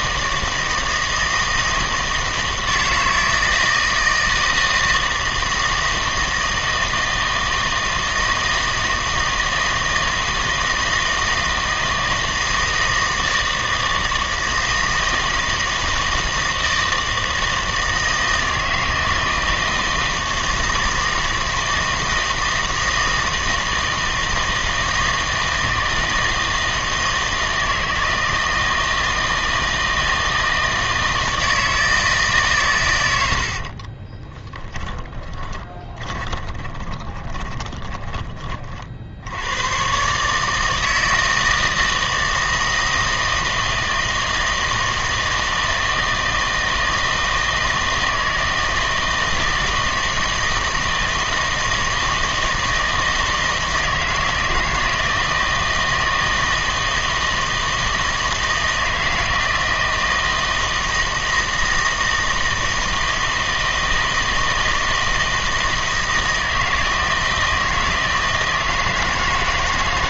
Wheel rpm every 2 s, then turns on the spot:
160, 160, 160, 160, 160, 160, 160, 160, 160, 160, 160, 160, 160, 160, 160, 160, 130, 20, 20, 30, 150, 160, 160, 160, 160, 160, 160, 170, 160, 160, 160, 160, 160, 160, 160.
34-38